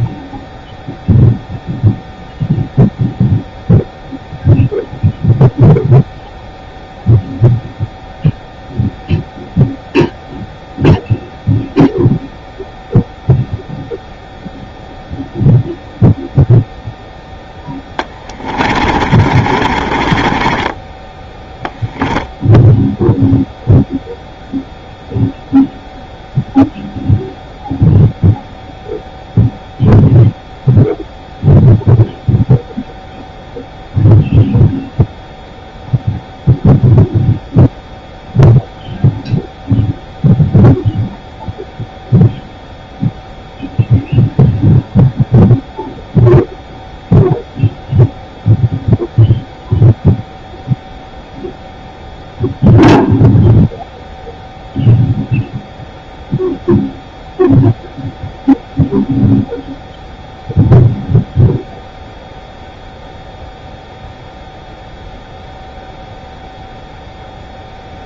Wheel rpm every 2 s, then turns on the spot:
0, 0, 0, 0, 0, 0, 0, 0, 0, 40, 20, 0, 0, 0, 0, 0, 0, 0, 0, 0, 0, 0, 0, 0, 0, 0, 0, 0, 0, 0, 0, 0, 0, 0.
18-22